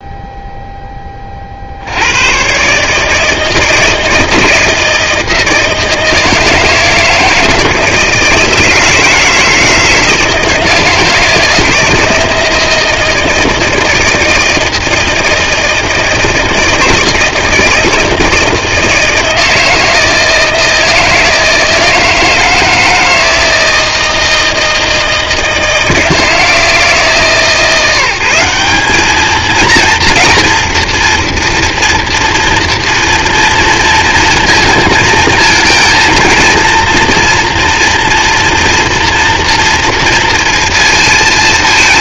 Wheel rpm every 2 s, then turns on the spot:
0, 130, 160, 160, 160, 160, 160, 160, 160, 160, 160, 160, 160, 160, 190, 230, 230, 230, 240, 230, 230.
none